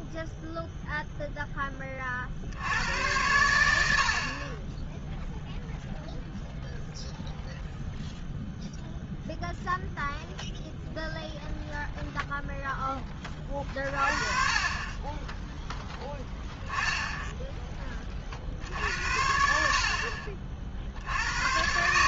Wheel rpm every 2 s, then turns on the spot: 0, 100, 10, 0, 0, 0, 40, 0, 20, 60, 140.
4-6